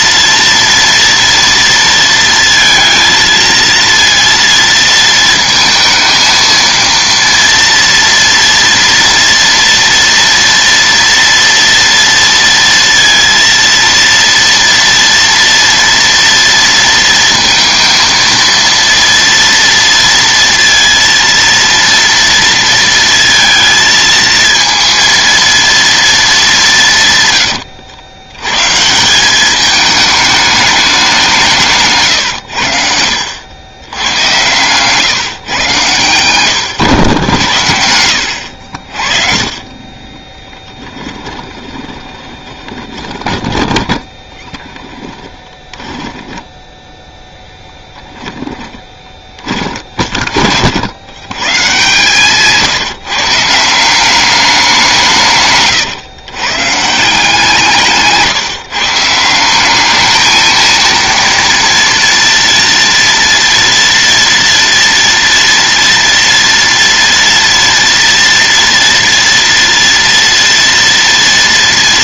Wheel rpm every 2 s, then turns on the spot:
230, 230, 230, 230, 230, 230, 230, 230, 230, 230, 230, 230, 220, 200, 150, 210, 100, 120, 110, 70, 10, 20, 10, 10, 20, 60, 150, 180, 140, 140, 220, 230, 240, 230, 230, 230.
40-50